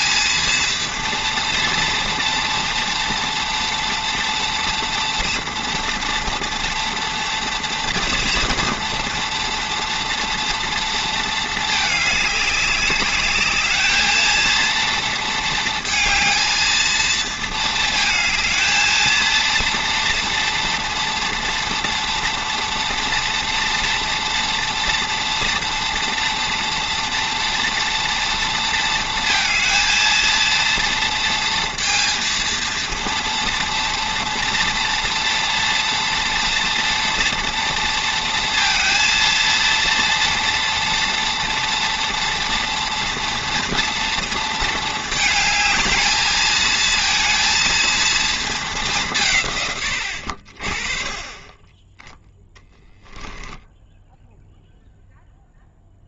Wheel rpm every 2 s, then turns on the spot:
230, 230, 240, 240, 230, 230, 200, 230, 220, 220, 230, 230, 240, 230, 230, 230, 230, 230, 230, 230, 230, 230, 220, 220, 180, 30, 10, 0.
52-54